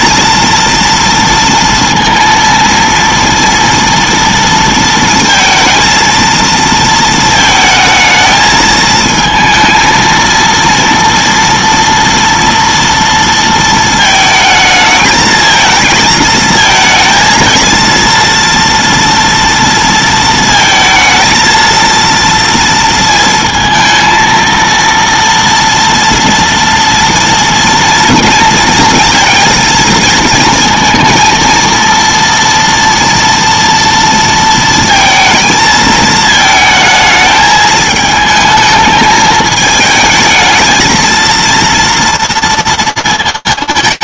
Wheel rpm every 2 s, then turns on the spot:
230, 230, 230, 230, 220, 230, 230, 220, 220, 230, 230, 230, 230, 230, 230, 230, 230, 230, 220, 220, 220, 200.
none